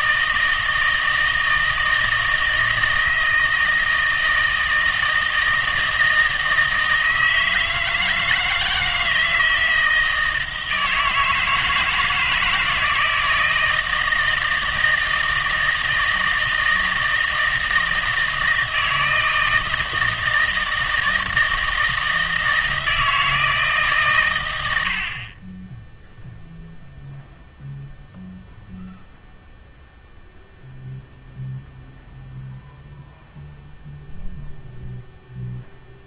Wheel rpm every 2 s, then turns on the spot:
160, 160, 160, 160, 160, 160, 160, 160, 160, 160, 160, 160, 90, 0, 0, 0, 0, 0.
none